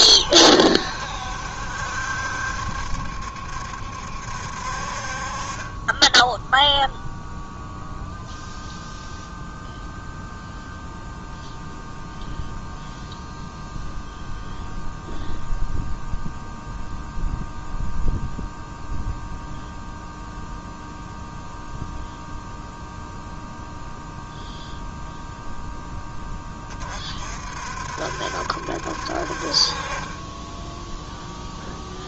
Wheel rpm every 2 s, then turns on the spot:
70, 70, 50, 0, 0, 0, 0, 0, 0, 0, 0, 0, 0, 30, 60, 10.
none